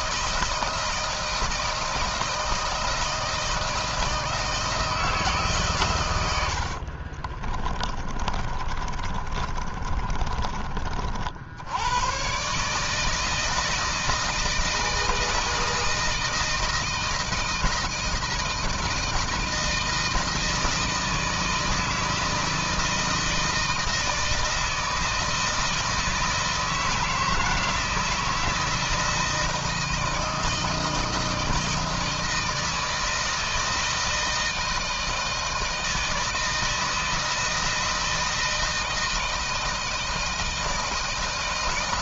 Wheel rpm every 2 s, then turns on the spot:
160, 160, 160, 80, 30, 30, 140, 160, 160, 160, 170, 160, 160, 160, 160, 160, 160, 160, 160, 160, 160.
6-10